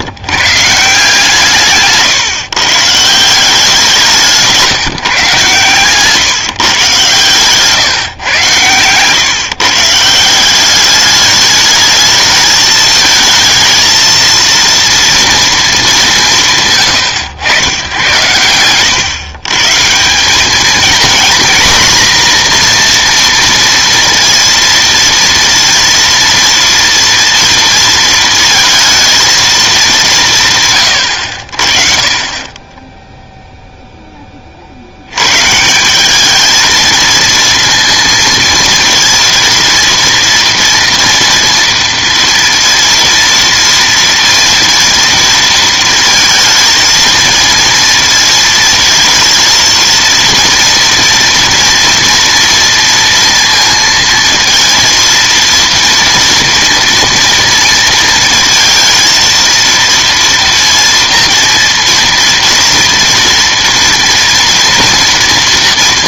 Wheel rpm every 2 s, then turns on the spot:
150, 130, 170, 140, 110, 190, 220, 230, 150, 110, 220, 240, 230, 230, 230, 130, 20, 40, 220, 230, 230, 230, 230, 220, 220, 230, 230, 230, 230, 230, 230, 230, 230.
none